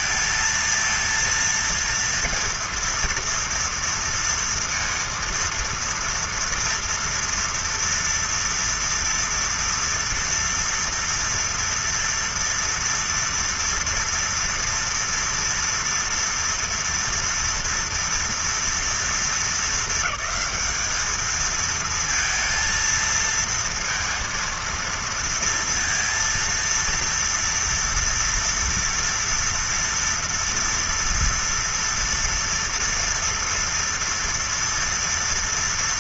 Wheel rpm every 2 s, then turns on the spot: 230, 230, 230, 230, 230, 230, 240, 230, 230, 230, 220, 230, 230, 230, 230, 230, 240, 230.
none